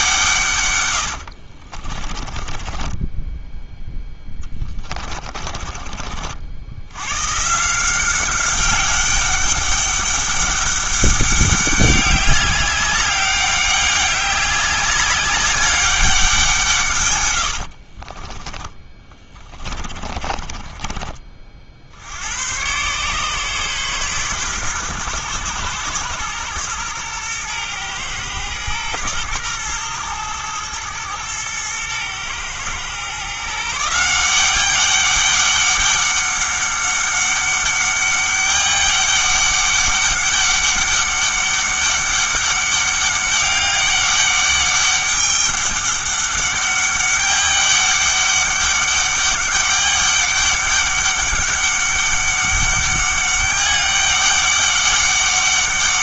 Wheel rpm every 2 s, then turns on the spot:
130, 20, 20, 70, 190, 200, 200, 200, 160, 20, 30, 110, 120, 110, 120, 110, 120, 190, 200, 200, 200, 200, 200, 200, 200, 200, 200, 200.
2-6 18-22